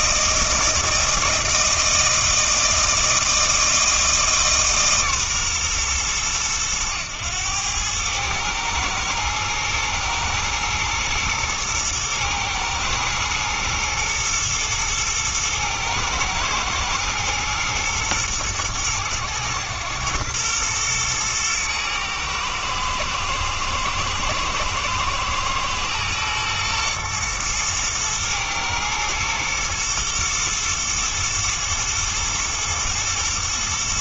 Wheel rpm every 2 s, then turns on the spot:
160, 160, 150, 110, 110, 110, 110, 110, 110, 110, 110, 110, 110, 120, 110, 110, 110.
none